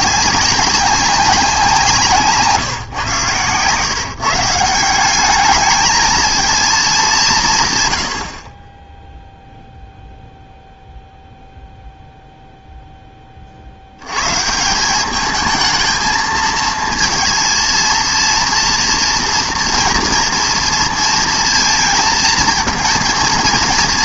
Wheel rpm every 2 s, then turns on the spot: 200, 150, 160, 230, 40, 0, 0, 150, 220, 230, 230, 230.
none